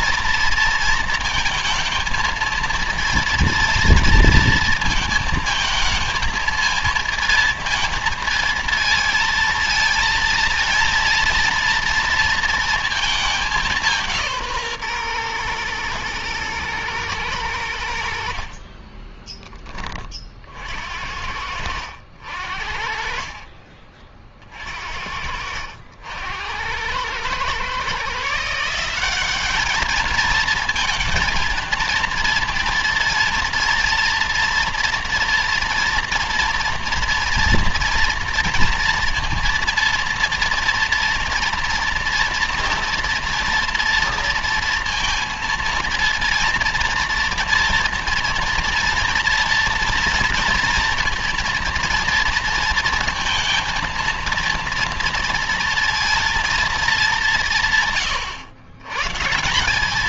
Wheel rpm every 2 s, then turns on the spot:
230, 230, 220, 220, 230, 230, 220, 130, 110, 20, 60, 50, 50, 100, 180, 230, 230, 230, 230, 230, 230, 230, 230, 230, 230, 230, 230, 230, 210, 130.
18-20 22-24